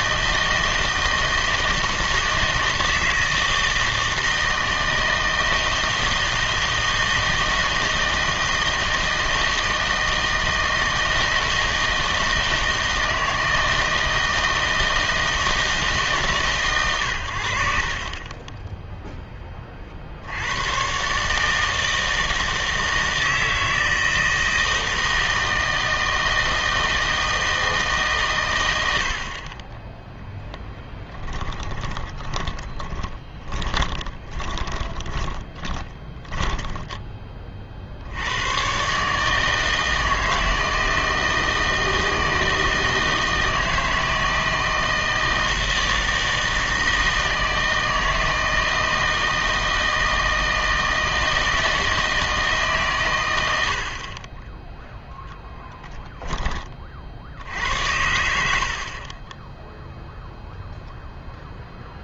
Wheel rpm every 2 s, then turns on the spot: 160, 160, 160, 160, 160, 160, 160, 160, 130, 10, 100, 160, 160, 160, 100, 10, 20, 20, 10, 110, 160, 160, 160, 160, 160, 160, 140, 10, 30, 70, 0.
30-38